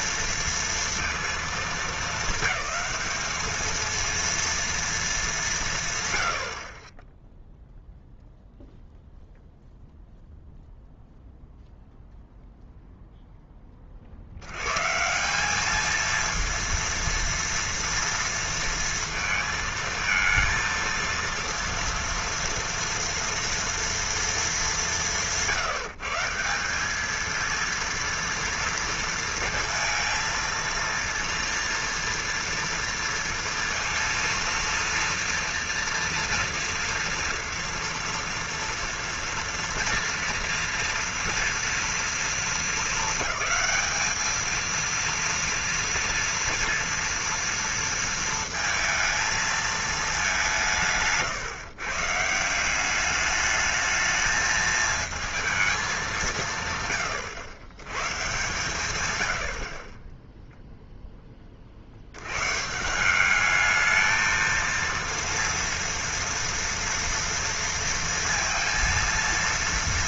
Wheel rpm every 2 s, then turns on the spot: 230, 220, 220, 0, 0, 0, 0, 150, 230, 230, 230, 230, 170, 220, 230, 230, 230, 230, 230, 240, 230, 220, 220, 230, 230, 190, 170, 220, 160, 130, 0, 120, 230, 230, 230.
none